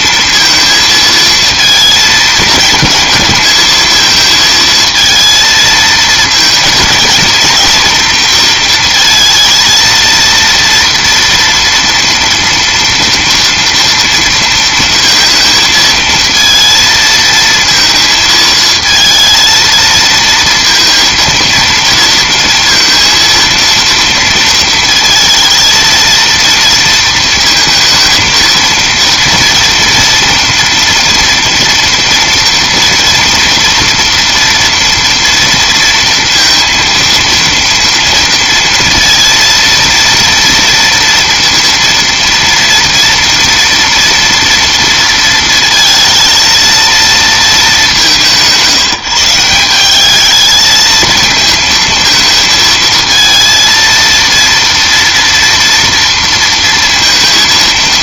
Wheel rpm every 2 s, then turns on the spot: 230, 220, 220, 230, 230, 230, 230, 230, 230, 220, 230, 230, 230, 230, 230, 240, 230, 230, 230, 230, 230, 230, 230, 230, 180, 220, 220, 230, 230.
none